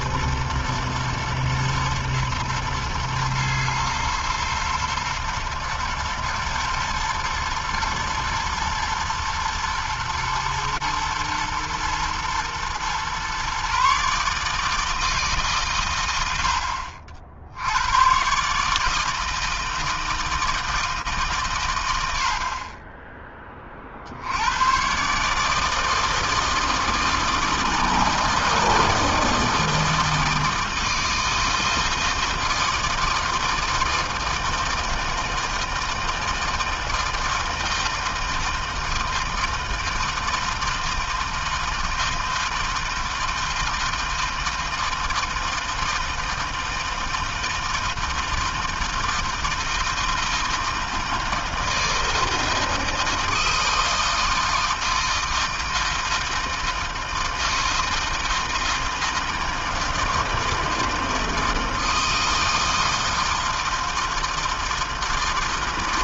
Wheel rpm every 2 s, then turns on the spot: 110, 110, 110, 110, 110, 110, 110, 150, 80, 140, 160, 60, 80, 160, 160, 160, 160, 160, 160, 160, 160, 160, 160, 160, 160, 160, 160, 160, 160, 160, 160, 160, 160.
none